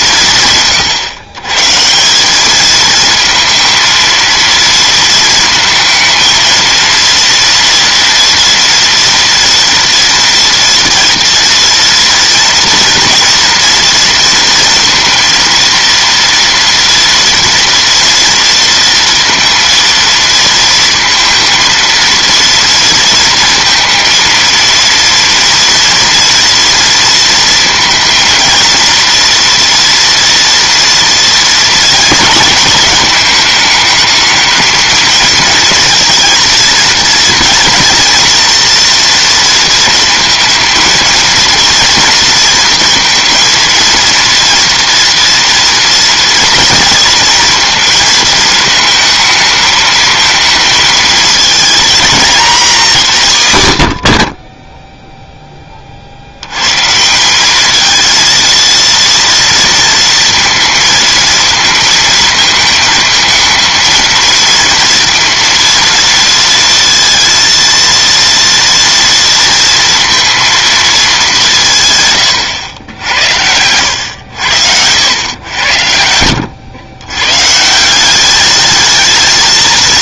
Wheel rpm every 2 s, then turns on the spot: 140, 210, 230, 230, 230, 230, 230, 230, 230, 230, 230, 230, 230, 230, 230, 230, 230, 220, 230, 230, 230, 230, 230, 230, 220, 220, 200, 10, 120, 230, 230, 220, 230, 230, 230, 230, 110, 80, 90, 210.
none